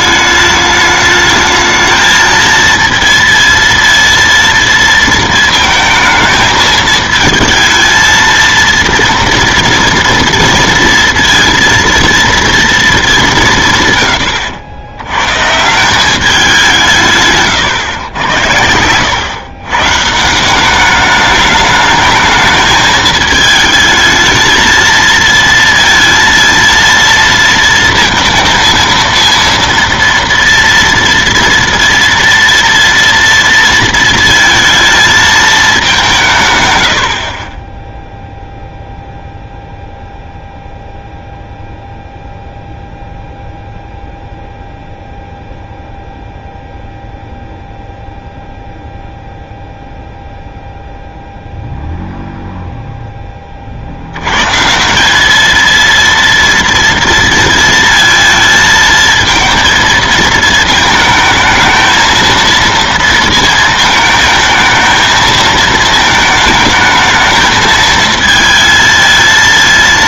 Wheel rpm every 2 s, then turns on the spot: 210, 230, 230, 220, 230, 230, 230, 90, 180, 90, 190, 220, 220, 230, 230, 230, 230, 230, 130, 0, 0, 0, 0, 0, 0, 0, 0, 140, 230, 220, 220, 230, 220, 220, 230.
none